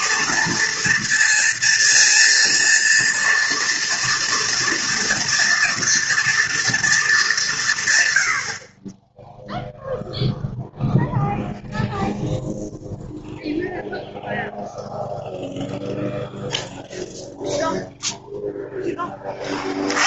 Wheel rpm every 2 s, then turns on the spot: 230, 230, 230, 230, 60, 0, 0, 0, 0, 0.
none